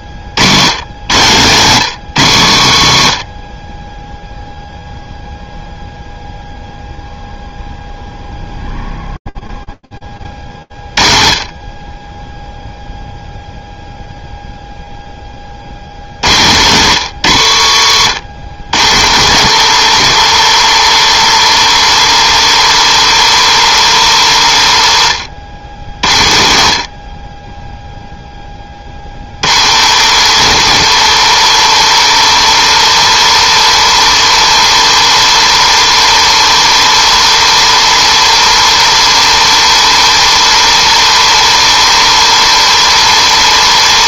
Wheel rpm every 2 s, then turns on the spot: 100, 110, 0, 0, 0, 40, 0, 0, 130, 120, 150, 150, 110, 60, 50, 160, 150, 150, 150, 150, 150, 150.
16-18